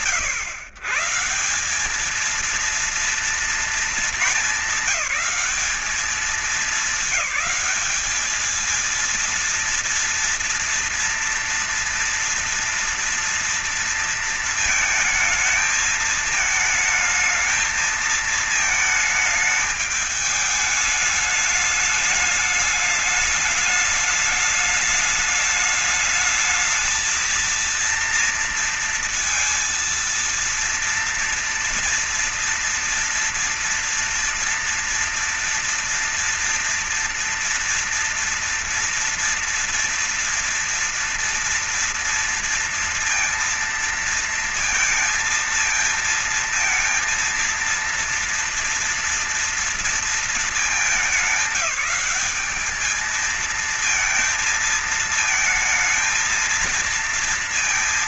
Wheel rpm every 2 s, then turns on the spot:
130, 230, 200, 210, 220, 230, 230, 220, 220, 220, 210, 210, 210, 220, 230, 230, 240, 230, 230, 230, 240, 230, 230, 230, 230, 210, 200, 220, 230.
none